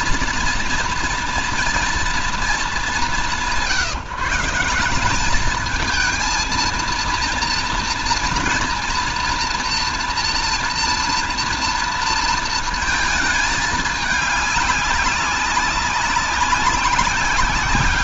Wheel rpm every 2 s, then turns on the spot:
240, 210, 170, 230, 230, 230, 230, 210, 190.
none